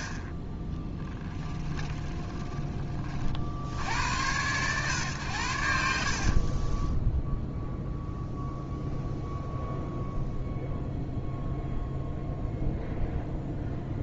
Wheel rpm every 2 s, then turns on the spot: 30, 40, 120, 20, 0, 0, 0.
6-8